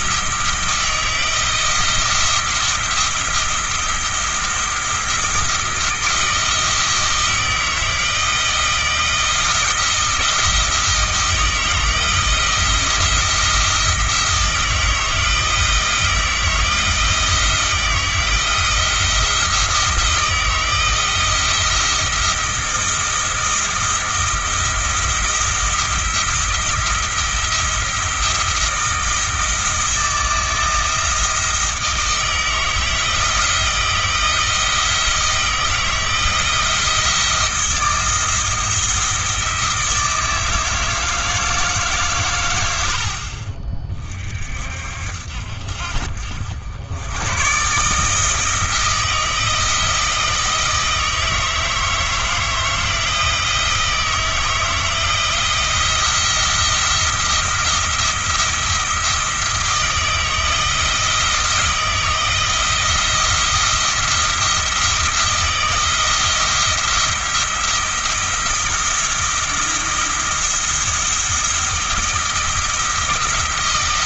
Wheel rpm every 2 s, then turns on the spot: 160, 170, 170, 160, 160, 160, 170, 160, 160, 170, 170, 170, 170, 170, 160, 160, 160, 170, 170, 160, 160, 70, 60, 90, 160, 160, 160, 160, 170, 170, 170, 170, 170, 170, 170, 170, 170.
none